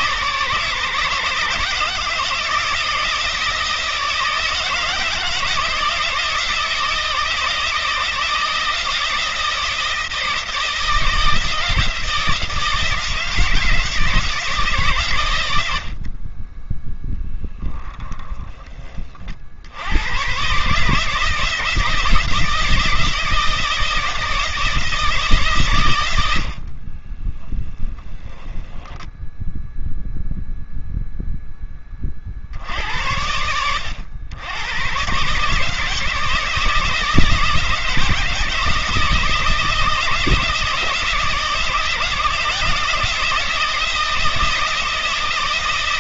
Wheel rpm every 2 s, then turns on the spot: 150, 160, 160, 160, 160, 160, 160, 80, 0, 100, 160, 160, 110, 10, 0, 50, 100, 160, 160, 160, 160, 170, 160.
none